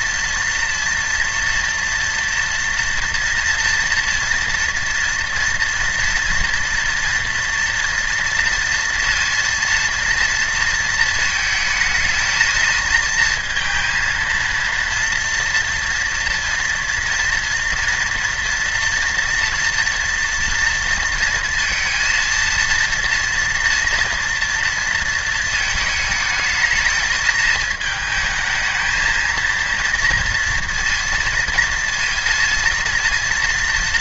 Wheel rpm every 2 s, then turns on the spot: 240, 230, 240, 230, 230, 230, 220, 230, 230, 230, 230, 230, 230, 220, 220, 230, 230.
none